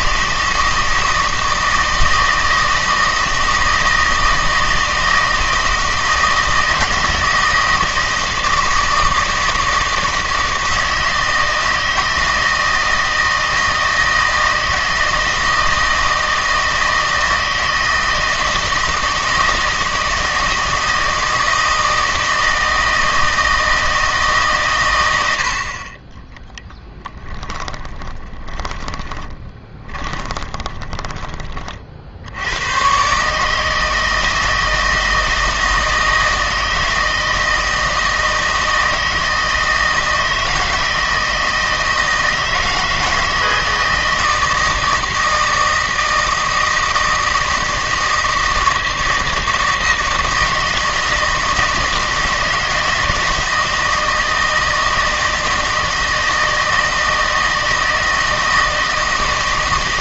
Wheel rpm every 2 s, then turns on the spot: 160, 160, 160, 160, 160, 160, 160, 160, 160, 160, 160, 160, 130, 30, 20, 20, 100, 160, 160, 160, 160, 160, 160, 160, 160, 160, 160, 160, 160, 160.
26-32